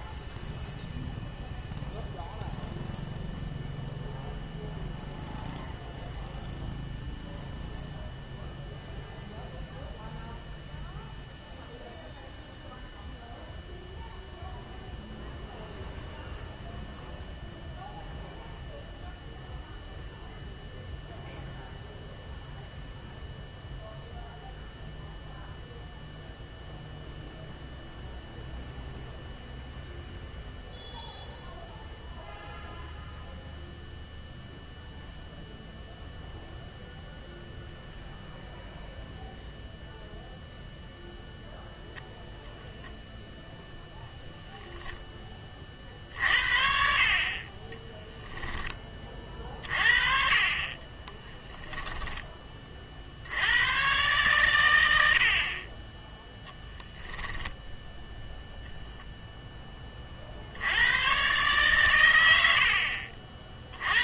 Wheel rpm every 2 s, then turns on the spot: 0, 0, 0, 0, 0, 0, 0, 0, 0, 0, 0, 0, 0, 0, 0, 0, 0, 0, 0, 0, 0, 0, 0, 50, 20, 30, 50, 90, 0, 0, 90, 60.
50-52 62-64